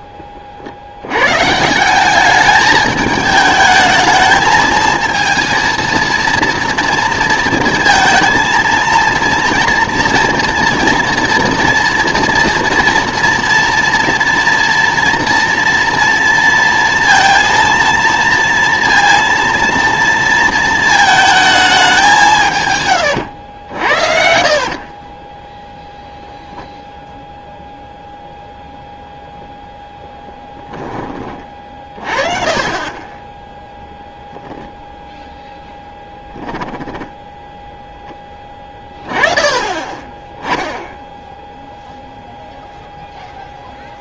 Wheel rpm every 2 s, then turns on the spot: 50, 210, 220, 230, 230, 240, 230, 230, 230, 230, 230, 140, 40, 0, 0, 10, 40, 0, 10, 20, 10, 0.
24-26 36-38